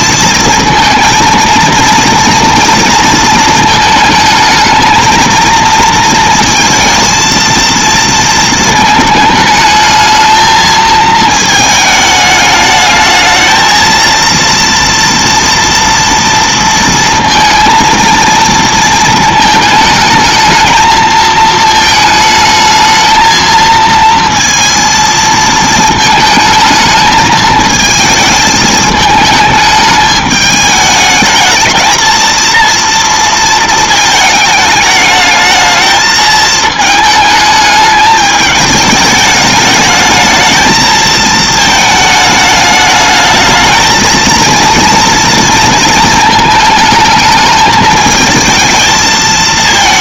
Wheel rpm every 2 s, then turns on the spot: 220, 230, 220, 230, 220, 220, 210, 230, 230, 230, 220, 220, 230, 220, 220, 210, 230, 220, 220, 210, 220, 210, 230, 220, 220.
none